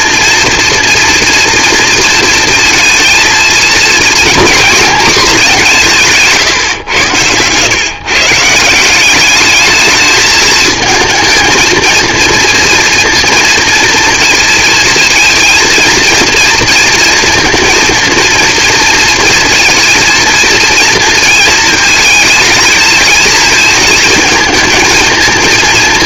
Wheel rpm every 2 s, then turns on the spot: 240, 230, 230, 110, 190, 230, 230, 230, 230, 230, 230, 220, 230.
none